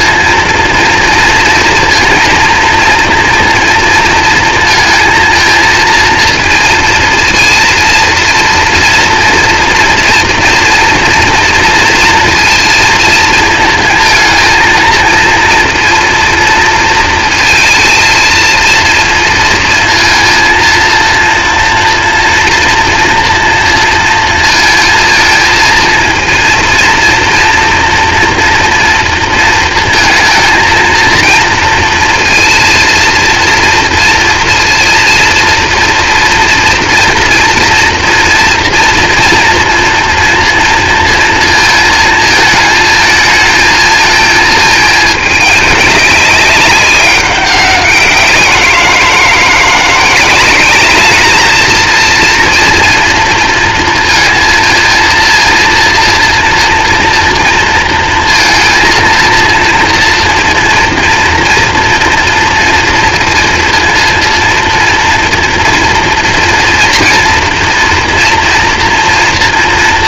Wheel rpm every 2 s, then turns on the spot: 230, 230, 230, 230, 230, 230, 230, 230, 230, 230, 230, 230, 220, 230, 230, 230, 230, 230, 230, 230, 230, 220, 220, 200, 170, 210, 230, 230, 230, 230, 230, 230, 230, 230, 230.
none